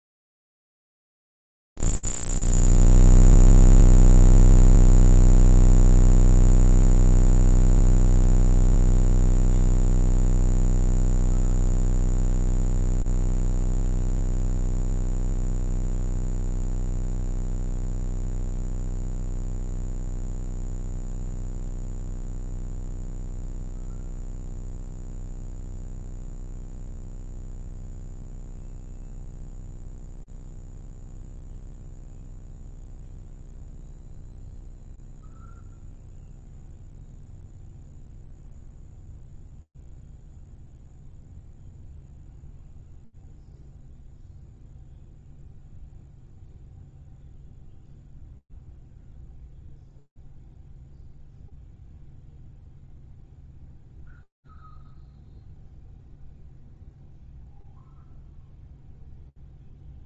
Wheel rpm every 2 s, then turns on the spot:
0, 0, 0, 0, 0, 0, 0, 0, 0, 0, 0, 0, 0, 0, 0, 0, 0, 0, 0, 0, 0, 0, 0, 0, 0, 0, 0, 0, 0, 0.
none